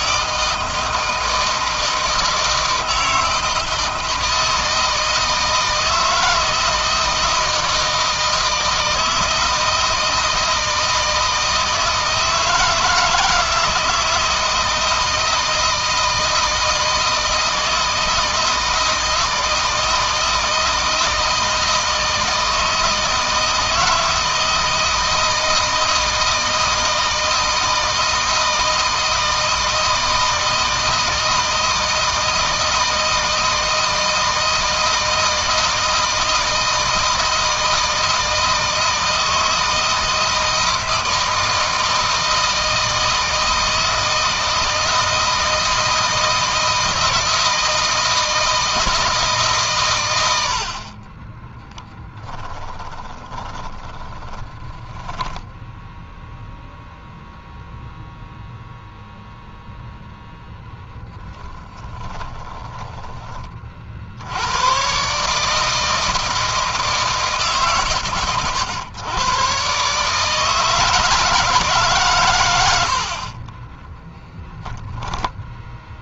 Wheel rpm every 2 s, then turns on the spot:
160, 160, 160, 160, 160, 160, 160, 160, 160, 160, 160, 160, 160, 160, 160, 160, 160, 160, 160, 160, 160, 160, 160, 160, 160, 50, 20, 10, 0, 0, 0, 20, 120, 160, 120, 160, 80, 10.
52-56 62-64 72-74